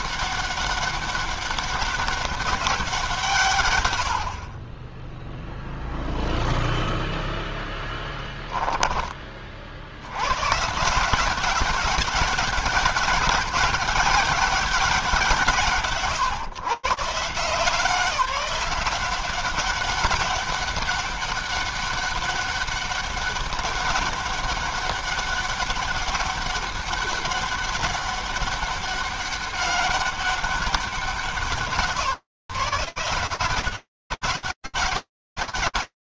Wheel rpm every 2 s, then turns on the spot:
200, 200, 70, 0, 10, 100, 200, 190, 150, 170, 190, 200, 200, 200, 200, 190, 170, 130.
none